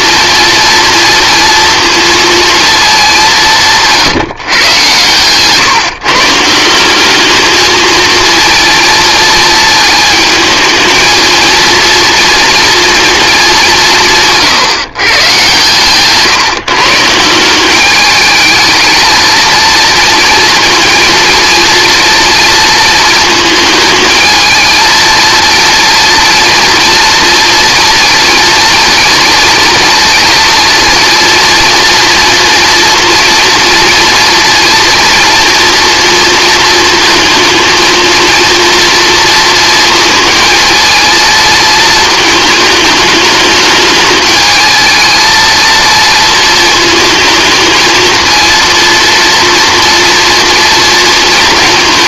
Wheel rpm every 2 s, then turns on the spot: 230, 190, 130, 210, 230, 230, 200, 130, 180, 230, 230, 230, 230, 230, 230, 230, 240, 230, 230, 230, 230, 210, 230, 220, 230, 230.
none